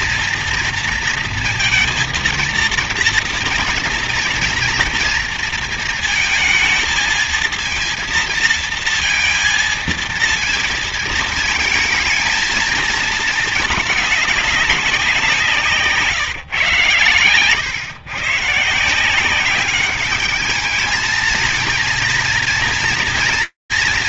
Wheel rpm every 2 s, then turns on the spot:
230, 230, 230, 230, 230, 230, 220, 190, 130, 160, 220, 230.
none